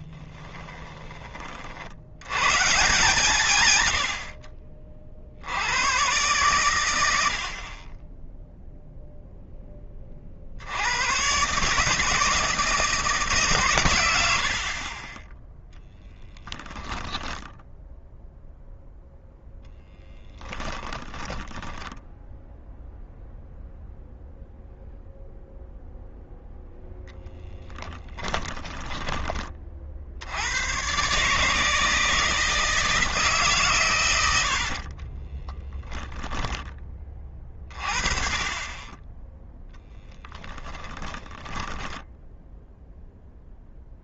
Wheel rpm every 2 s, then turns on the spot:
20, 140, 60, 90, 0, 100, 150, 30, 10, 0, 10, 0, 0, 10, 20, 120, 160, 40, 20, 20, 10, 0.
2-4 14-18 20-22 34-36 40-42